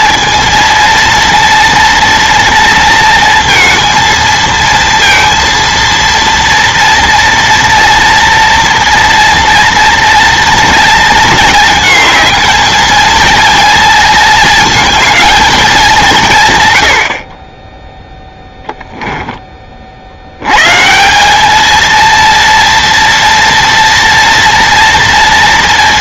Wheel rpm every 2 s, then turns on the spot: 230, 230, 230, 230, 230, 230, 230, 230, 110, 10, 100, 230, 230.
18-20